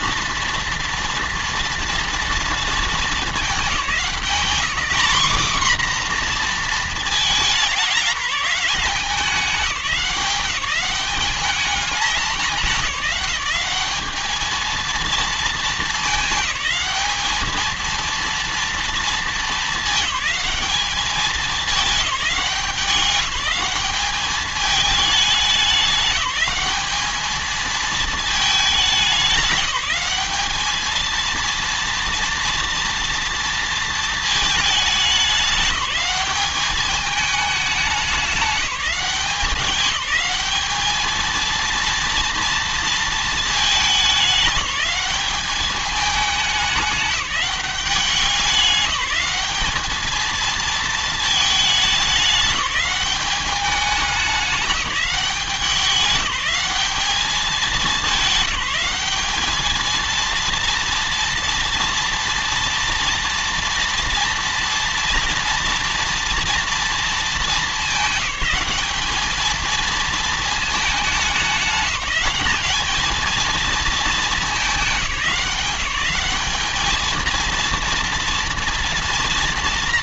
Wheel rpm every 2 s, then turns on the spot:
230, 220, 230, 230, 190, 180, 200, 220, 210, 230, 210, 200, 210, 210, 210, 220, 230, 210, 210, 190, 220, 230, 200, 210, 190, 230, 200, 200, 200, 190, 230, 230, 230, 230, 200, 210, 220, 200, 220, 230.
none